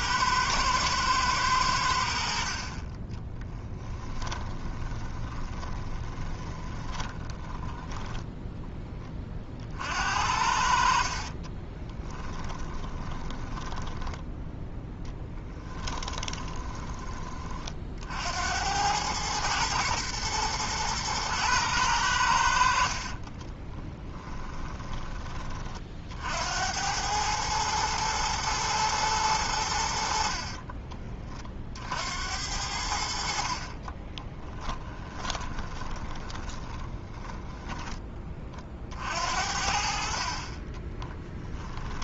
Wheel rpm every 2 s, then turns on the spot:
110, 30, 20, 10, 20, 50, 20, 10, 20, 100, 110, 50, 20, 90, 110, 20, 70, 10, 20, 50, 30.
2-8 10-14 34-38 40-42